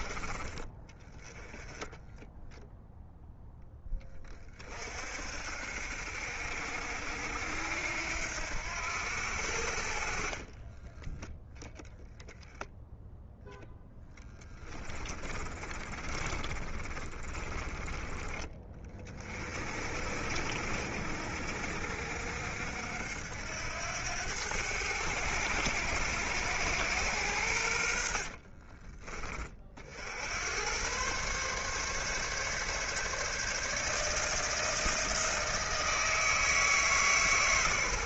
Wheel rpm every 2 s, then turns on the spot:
20, 0, 50, 70, 80, 10, 0, 20, 30, 40, 60, 70, 100, 110, 40, 120, 150, 160, 150.
14-18